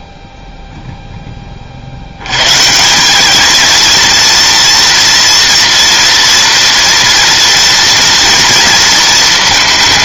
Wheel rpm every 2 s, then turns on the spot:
0, 130, 230, 230, 230.
none